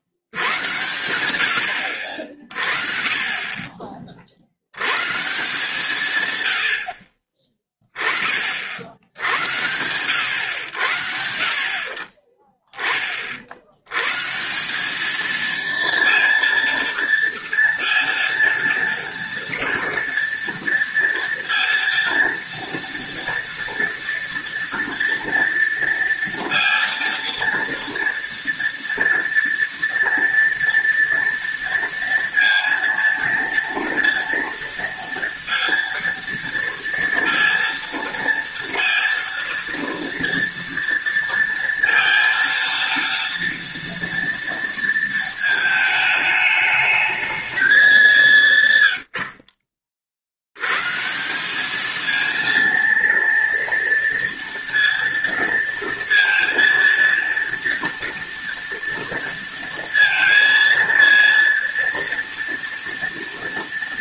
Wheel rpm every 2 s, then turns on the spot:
110, 30, 90, 80, 50, 80, 20, 180, 230, 230, 230, 230, 230, 230, 230, 230, 230, 230, 230, 230, 230, 230, 230, 210, 120, 120, 230, 230, 230, 230, 230, 240.
none